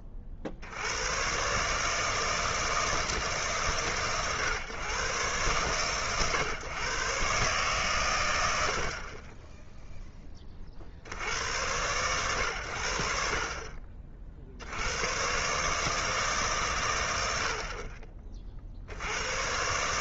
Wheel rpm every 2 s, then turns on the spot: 60, 160, 120, 130, 60, 50, 80, 90, 120, 70.
none